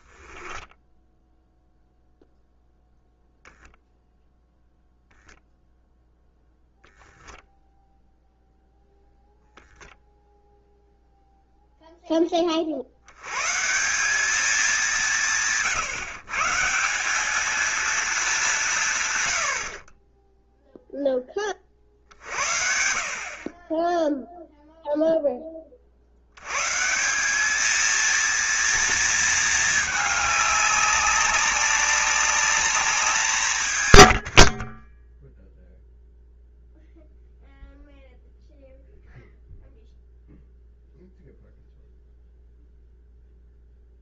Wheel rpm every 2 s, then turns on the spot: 10, 0, 0, 0, 0, 0, 40, 200, 170, 180, 0, 60, 0, 120, 230, 200, 200, 50, 0, 0, 0, 0.
0-2